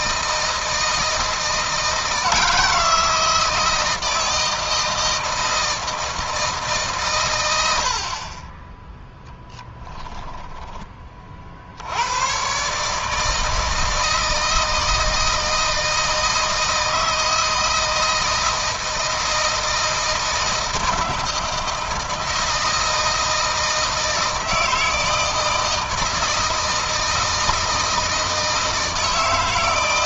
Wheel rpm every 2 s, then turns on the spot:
160, 160, 160, 150, 20, 20, 140, 160, 160, 160, 160, 160, 160, 170, 160.
none